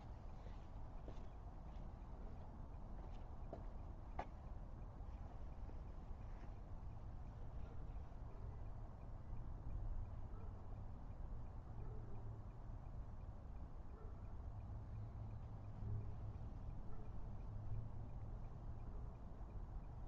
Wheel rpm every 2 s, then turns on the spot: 0, 0, 0, 0, 0, 0, 0, 0, 0, 0.
none